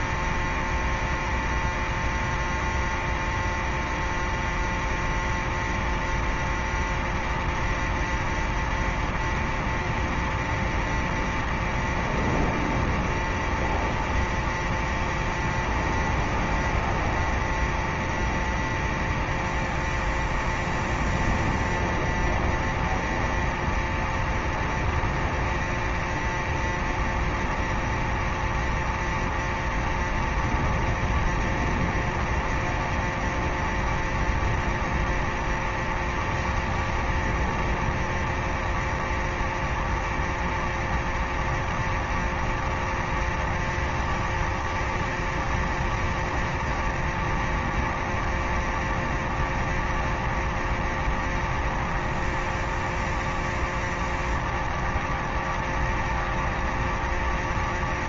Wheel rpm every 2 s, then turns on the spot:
0, 0, 0, 0, 0, 0, 0, 0, 0, 0, 0, 0, 0, 0, 0, 0, 0, 0, 0, 0, 0, 0, 0, 0, 0, 0, 0, 0, 0.
none